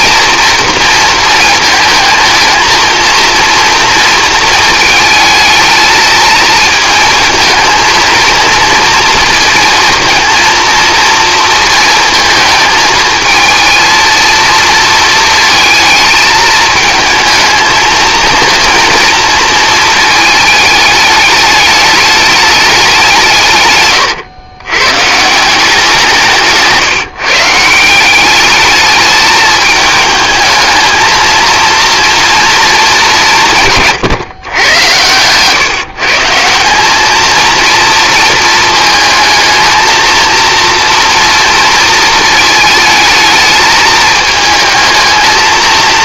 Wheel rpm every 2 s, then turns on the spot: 230, 220, 220, 220, 230, 230, 220, 230, 220, 230, 210, 200, 120, 160, 210, 220, 210, 110, 180, 220, 230, 220, 220.
26-28